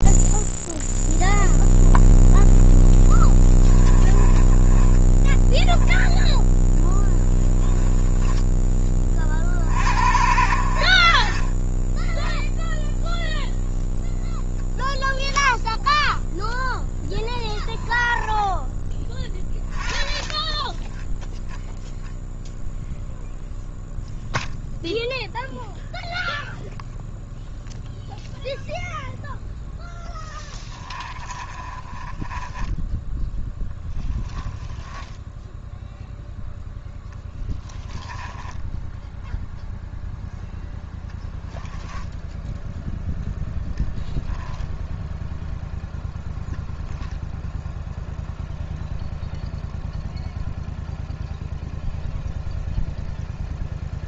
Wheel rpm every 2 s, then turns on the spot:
0, 10, 10, 10, 20, 50, 0, 0, 10, 10, 0, 0, 0, 0, 0, 30, 10, 10, 0, 10, 10, 0, 0, 0, 0, 0, 0.
2-8 16-18 30-32 34-36 40-42